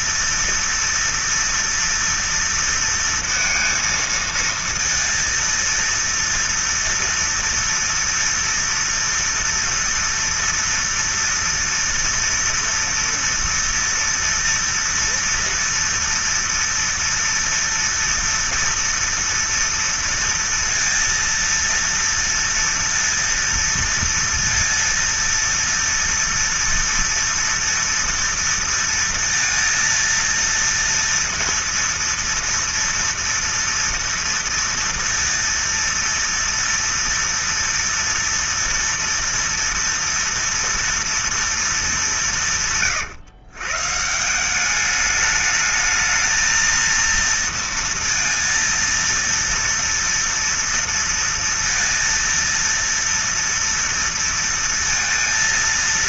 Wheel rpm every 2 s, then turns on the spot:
230, 230, 230, 230, 230, 230, 230, 230, 230, 230, 230, 230, 230, 230, 230, 230, 230, 230, 230, 230, 230, 150, 200, 230, 230, 230, 230, 230.
none